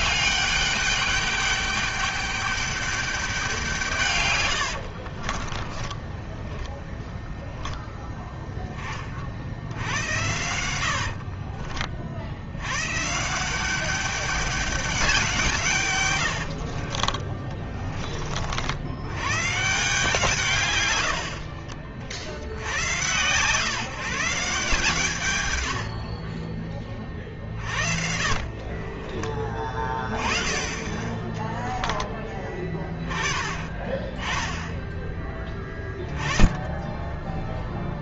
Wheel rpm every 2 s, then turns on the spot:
200, 200, 80, 10, 20, 90, 110, 200, 50, 80, 110, 90, 150, 20, 30, 20, 20, 10, 10.
4-8 10-12 16-18 28-32